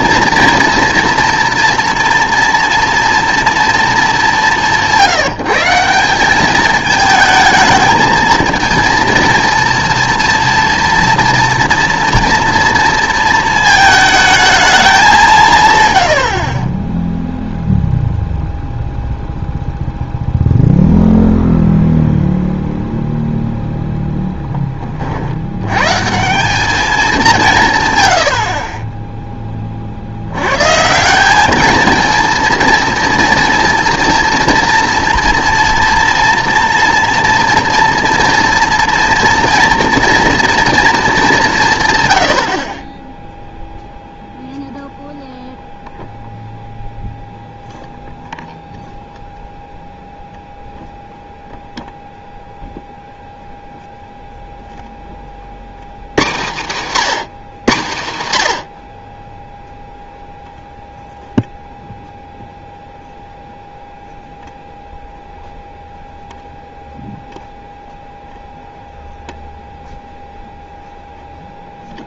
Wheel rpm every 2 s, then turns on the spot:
230, 230, 180, 210, 230, 230, 230, 210, 30, 0, 0, 0, 20, 190, 50, 130, 230, 230, 230, 230, 230, 50, 0, 0, 0, 0, 0, 0, 160, 90, 0, 0, 0, 0, 0, 0.
16-18 28-30